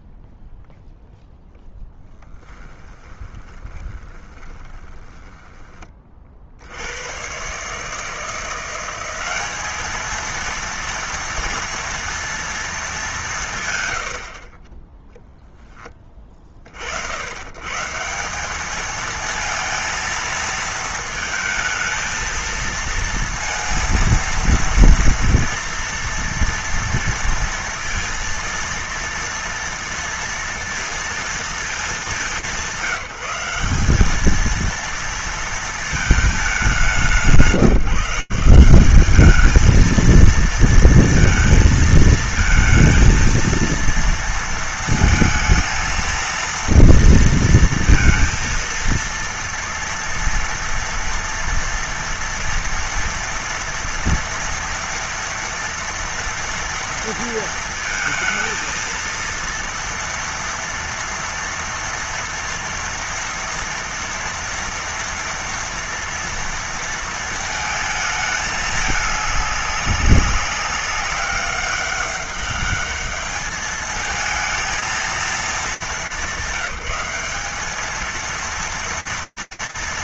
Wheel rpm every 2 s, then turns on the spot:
0, 20, 20, 130, 200, 230, 140, 0, 130, 220, 220, 230, 230, 230, 230, 220, 190, 230, 160, 220, 220, 230, 220, 230, 230, 230, 230, 230, 230, 230, 230, 230, 230, 230, 200, 200, 210, 220, 200, 220.
2-6 12-14